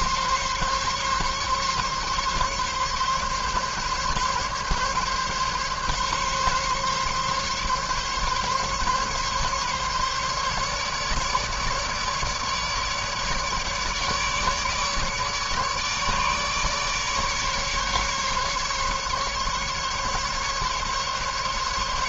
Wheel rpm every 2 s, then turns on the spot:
140, 140, 140, 140, 140, 140, 150, 150, 150, 140, 140.
none